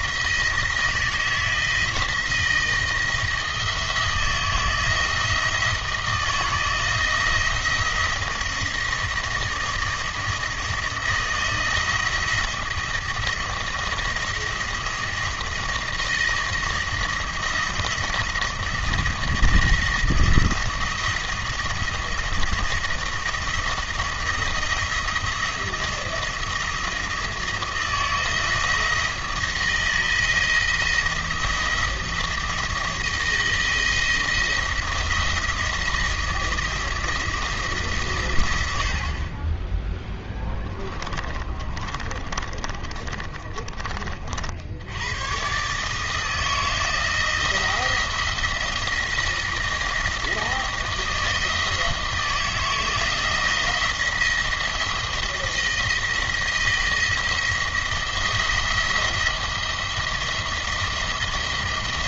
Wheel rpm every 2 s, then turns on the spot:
160, 170, 170, 160, 170, 160, 170, 170, 170, 170, 170, 170, 170, 170, 160, 170, 170, 170, 170, 80, 20, 40, 70, 160, 170, 160, 160, 160, 160, 170, 170.
40-44